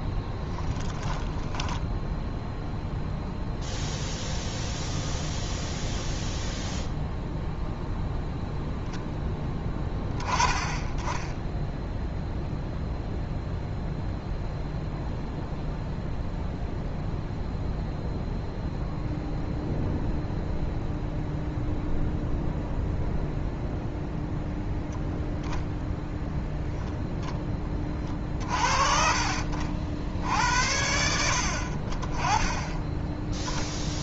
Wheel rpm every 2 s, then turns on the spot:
10, 0, 0, 0, 0, 20, 0, 0, 0, 0, 0, 0, 0, 0, 40, 80, 10.
none